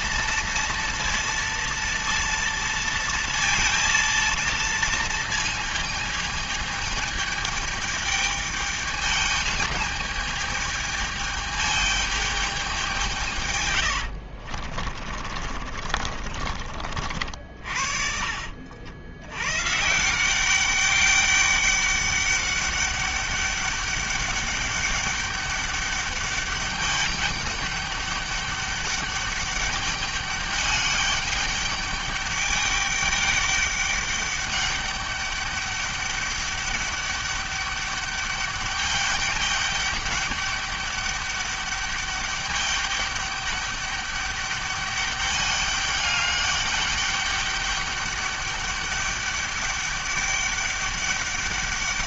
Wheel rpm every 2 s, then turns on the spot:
230, 230, 230, 220, 210, 220, 180, 40, 50, 80, 200, 200, 200, 210, 200, 200, 200, 200, 200, 210, 200, 200, 200, 200, 200, 200.
14-16